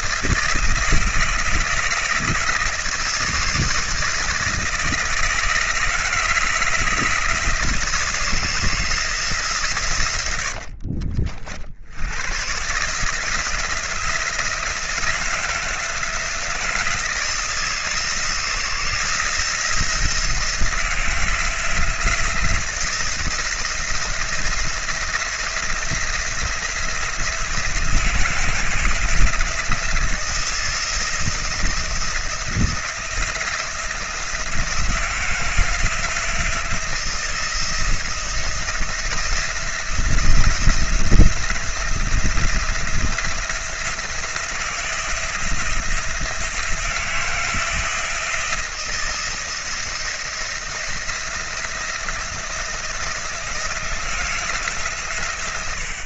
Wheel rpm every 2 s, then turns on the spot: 160, 160, 160, 160, 160, 60, 150, 170, 160, 170, 170, 170, 170, 170, 160, 170, 170, 170, 170, 170, 170, 170, 170, 170, 160, 170, 170, 140.
10-12